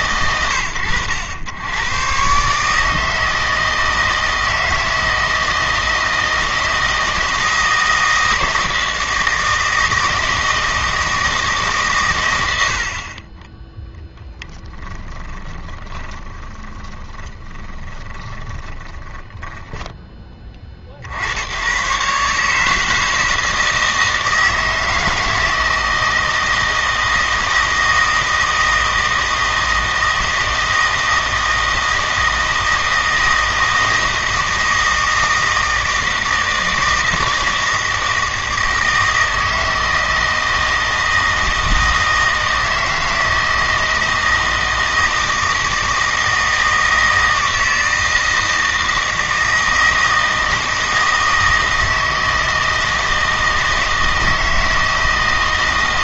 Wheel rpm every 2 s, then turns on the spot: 110, 150, 160, 160, 160, 160, 80, 10, 20, 20, 40, 150, 160, 160, 160, 160, 160, 160, 160, 160, 160, 160, 160, 160, 160, 160, 160, 160.
14-20